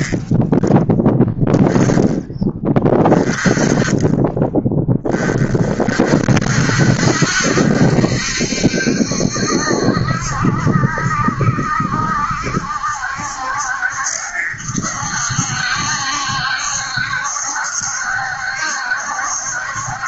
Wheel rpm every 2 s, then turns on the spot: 10, 20, 20, 60, 70, 70, 70, 70, 70, 70.
none